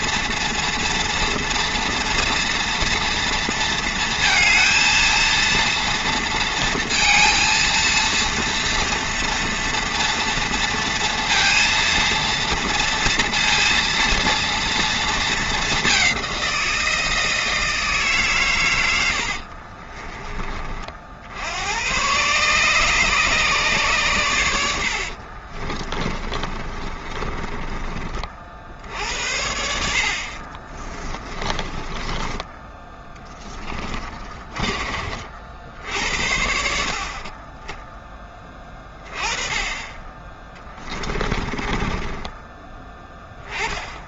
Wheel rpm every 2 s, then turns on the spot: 230, 230, 230, 230, 230, 230, 230, 230, 180, 120, 30, 140, 90, 30, 60, 40, 10, 30, 70, 20, 20, 20.
26-28 30-34 40-44